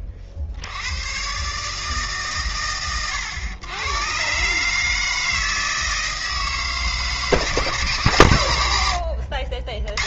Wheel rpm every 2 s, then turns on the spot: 80, 100, 150, 160, 120.
none